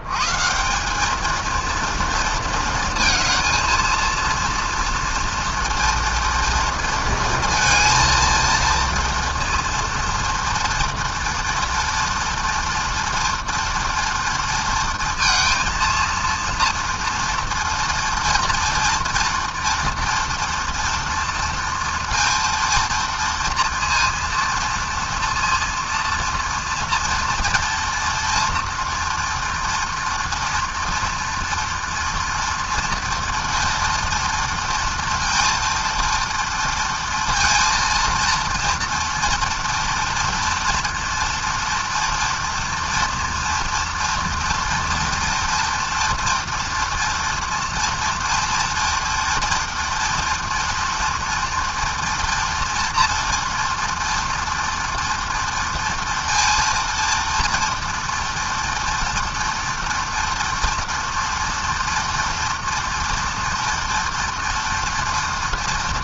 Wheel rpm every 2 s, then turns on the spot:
170, 220, 230, 230, 230, 230, 230, 230, 230, 230, 230, 230, 230, 240, 230, 230, 230, 230, 230, 230, 230, 230, 230, 230, 240, 240, 230, 230, 230, 230, 230, 230, 230.
none